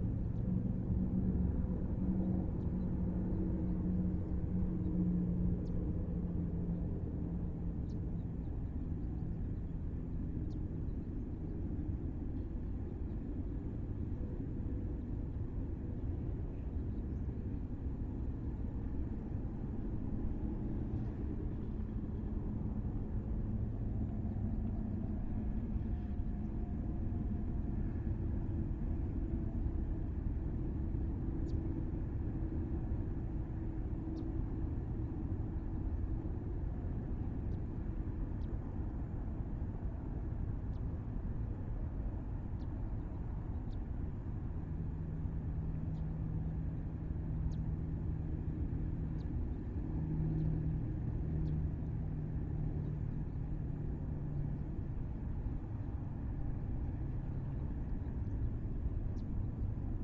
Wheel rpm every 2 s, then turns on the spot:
0, 0, 0, 0, 0, 0, 0, 0, 0, 0, 0, 0, 0, 0, 0, 0, 0, 0, 0, 0, 0, 0, 0, 0, 0, 0, 0, 0, 0, 0.
none